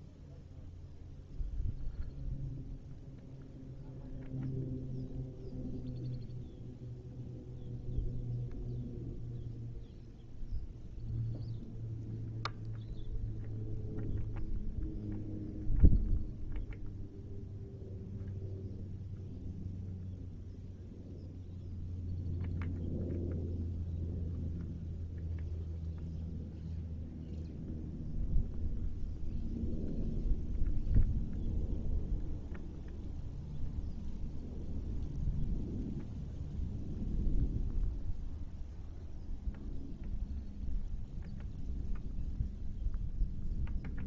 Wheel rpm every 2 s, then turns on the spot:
0, 0, 0, 0, 0, 0, 0, 0, 0, 0, 0, 0, 0, 0, 0, 0, 0, 0, 0, 0, 0, 0.
none